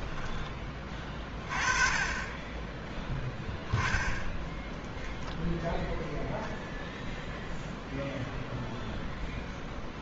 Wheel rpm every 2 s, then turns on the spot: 30, 10, 0, 0, 0.
none